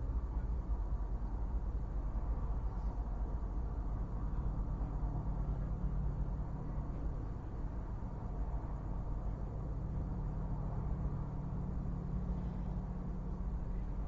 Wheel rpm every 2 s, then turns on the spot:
0, 0, 0, 0, 0, 0, 0.
none